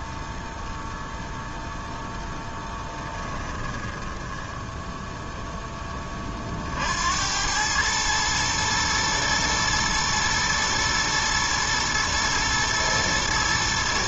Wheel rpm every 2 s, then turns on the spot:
0, 10, 10, 40, 110, 120, 110.
2-4